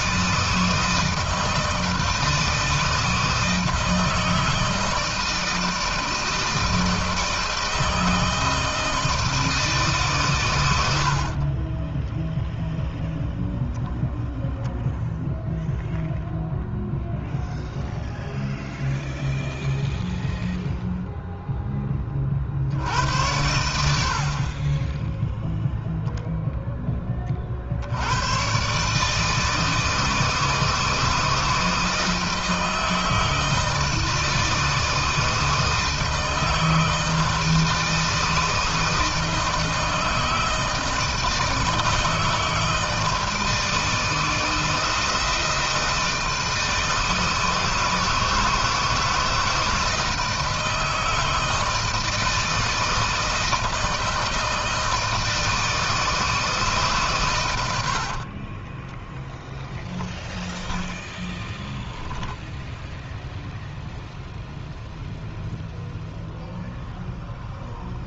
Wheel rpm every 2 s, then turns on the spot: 160, 160, 160, 160, 160, 110, 0, 0, 0, 0, 0, 60, 30, 10, 140, 160, 160, 160, 160, 160, 160, 160, 160, 160, 160, 160, 160, 160, 150, 20, 10, 10, 0, 0.
10-12 58-60